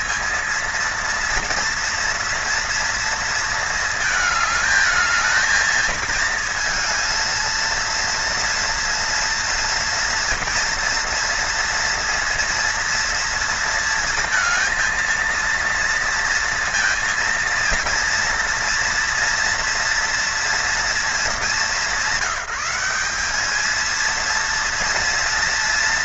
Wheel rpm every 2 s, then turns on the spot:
220, 230, 210, 220, 230, 230, 230, 230, 230, 230, 220, 190, 230.
none